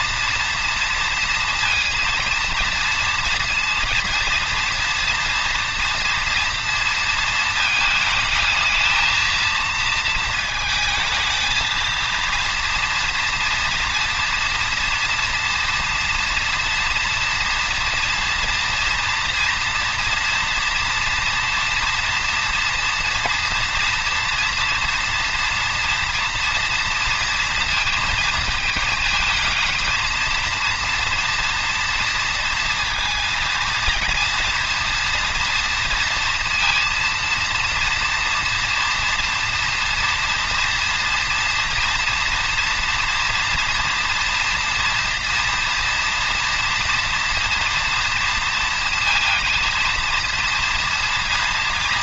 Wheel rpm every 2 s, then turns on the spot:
230, 230, 230, 230, 220, 220, 230, 230, 230, 230, 230, 240, 230, 230, 230, 230, 230, 230, 230, 240, 230, 230, 230, 240, 230, 230.
none